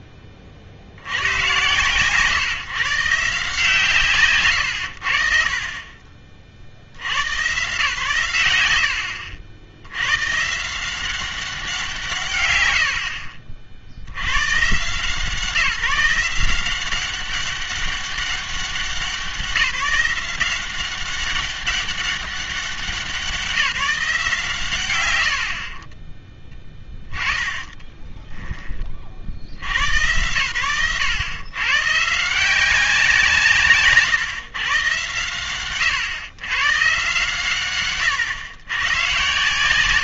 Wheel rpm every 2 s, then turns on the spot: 40, 140, 110, 70, 100, 160, 80, 140, 180, 190, 180, 180, 140, 10, 30, 100, 180, 120, 120, 120.
12-14